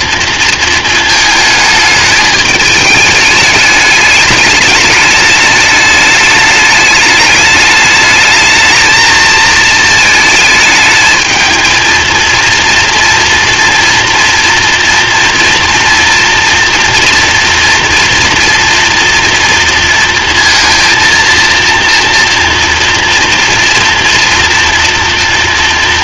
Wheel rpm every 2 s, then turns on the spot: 230, 210, 210, 210, 220, 220, 230, 230, 230, 230, 230, 230, 230.
none